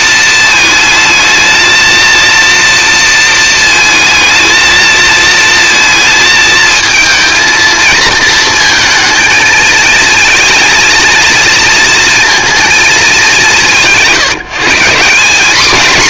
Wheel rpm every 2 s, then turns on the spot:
220, 230, 230, 230, 230, 240, 150, 210.
none